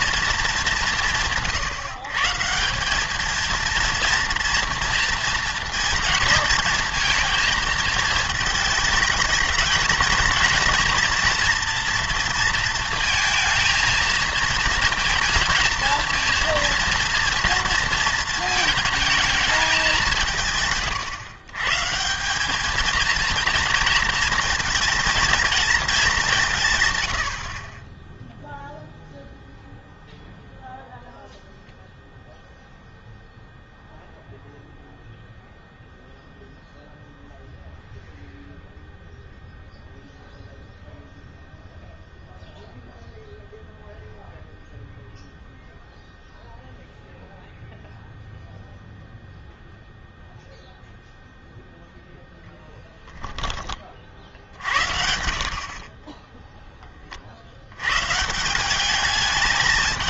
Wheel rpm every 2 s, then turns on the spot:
210, 180, 230, 230, 220, 230, 230, 230, 230, 220, 140, 210, 230, 130, 0, 0, 0, 0, 0, 0, 0, 0, 0, 0, 0, 0, 0, 60, 10, 180.
none